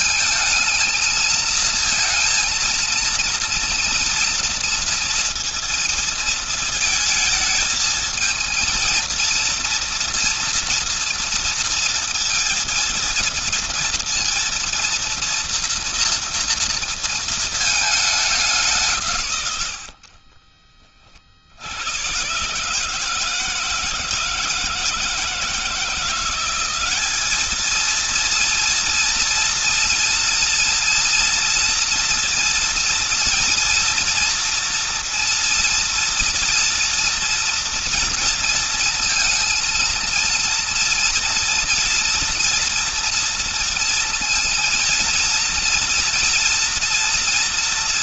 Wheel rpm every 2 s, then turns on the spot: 220, 230, 230, 220, 230, 230, 230, 230, 230, 160, 40, 150, 160, 200, 230, 230, 230, 230, 230, 230, 230, 230, 230, 230.
none